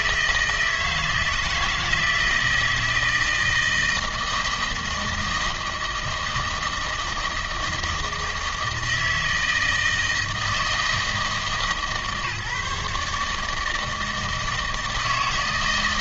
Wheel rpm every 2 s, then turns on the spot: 160, 160, 160, 160, 160, 160, 150, 160.
none